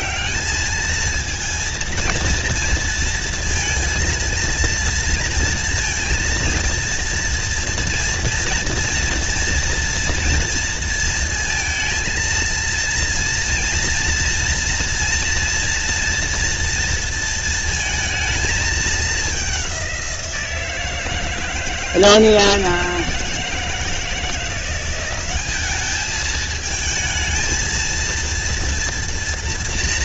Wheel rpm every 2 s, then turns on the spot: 210, 230, 230, 230, 240, 230, 230, 230, 230, 220, 160, 170, 180, 220, 230.
none